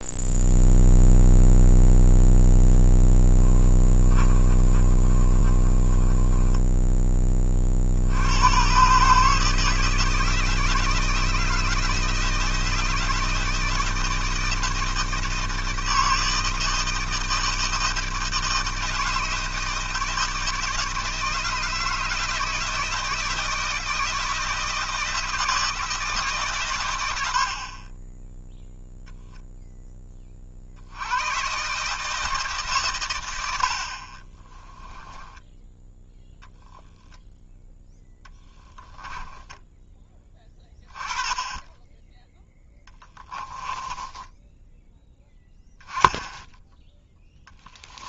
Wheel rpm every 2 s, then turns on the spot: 0, 20, 40, 20, 140, 160, 160, 160, 160, 160, 160, 160, 160, 90, 0, 80, 130, 20, 0, 10, 20, 20, 10, 10.
2-6 34-36 38-40 42-44 46-48